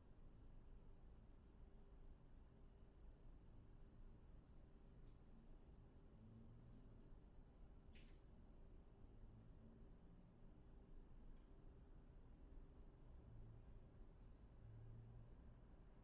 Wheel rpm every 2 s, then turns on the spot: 0, 0, 0, 0, 0, 0, 0, 0.
none